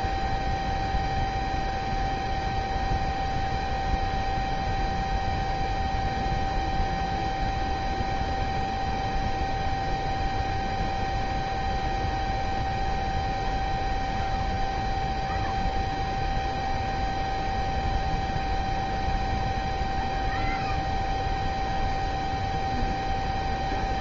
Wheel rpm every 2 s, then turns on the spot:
0, 0, 0, 0, 0, 0, 0, 0, 0, 0, 0, 0.
none